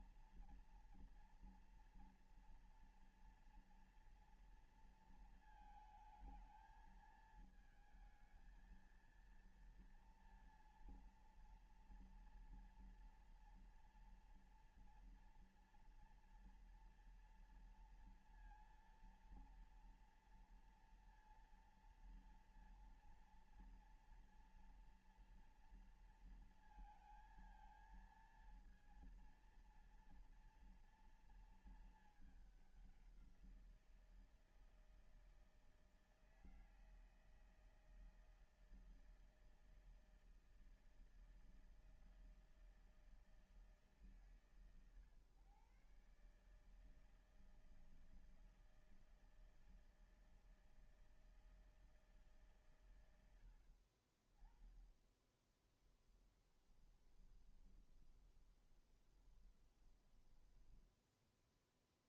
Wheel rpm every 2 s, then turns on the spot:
230, 230, 230, 220, 220, 230, 230, 230, 230, 230, 230, 230, 230, 230, 230, 230, 200, 160, 160, 160, 160, 160, 130, 150, 160, 160, 120, 10, 10, 20, 10.
56-60